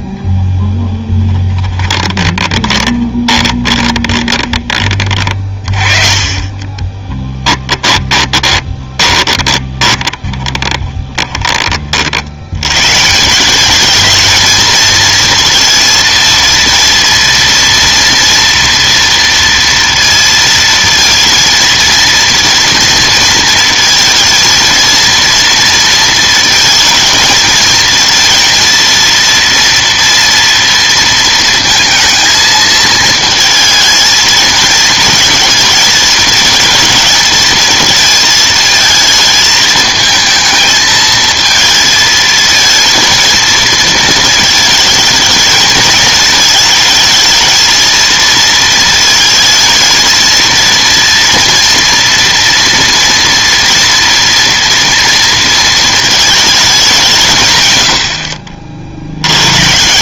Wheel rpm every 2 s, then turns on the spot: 0, 20, 20, 30, 20, 20, 110, 220, 230, 230, 230, 230, 230, 230, 230, 230, 230, 220, 220, 220, 220, 230, 220, 220, 230, 230, 230, 230, 210, 60.
2-4 6-12